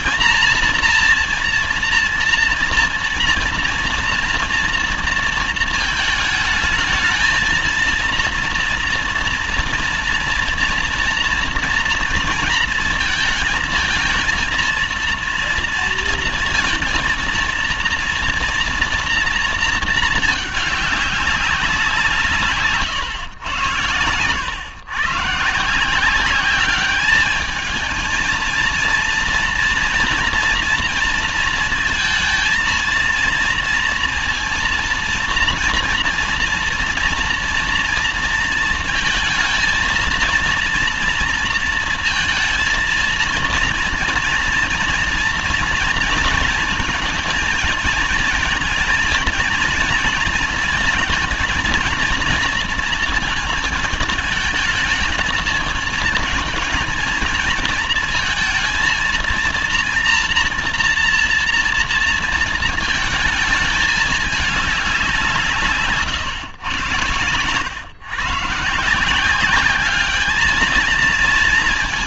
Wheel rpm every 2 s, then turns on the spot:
230, 230, 230, 220, 230, 230, 230, 230, 230, 230, 210, 140, 120, 200, 230, 230, 230, 230, 230, 220, 230, 230, 230, 230, 230, 230, 220, 220, 230, 230, 230, 220, 190, 100, 150, 220.
none